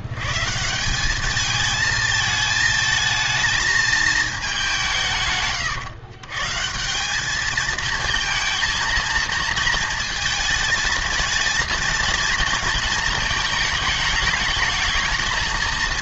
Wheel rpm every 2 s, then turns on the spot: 160, 220, 200, 150, 230, 220, 230, 220.
none